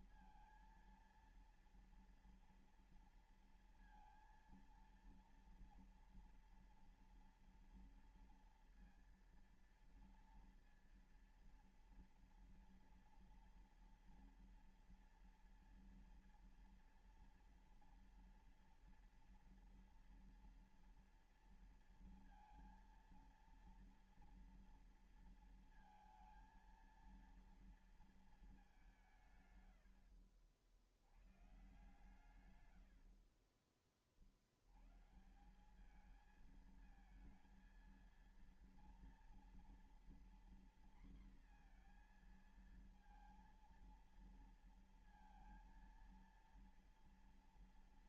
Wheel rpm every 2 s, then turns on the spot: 230, 230, 230, 230, 230, 230, 230, 230, 230, 230, 230, 230, 230, 230, 220, 80, 120, 60, 210, 230, 240, 230, 230, 230.
none